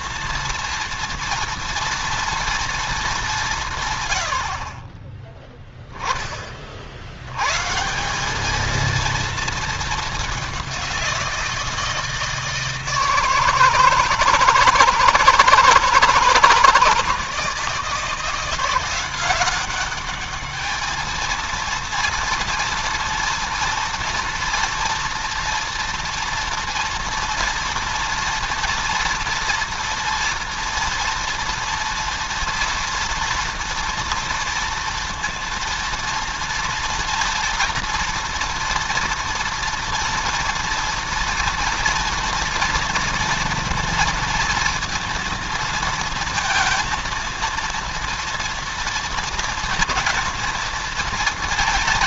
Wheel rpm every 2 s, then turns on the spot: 230, 220, 30, 50, 220, 190, 160, 160, 160, 180, 210, 230, 240, 240, 230, 240, 230, 230, 230, 230, 230, 230, 230, 230, 230, 230.
none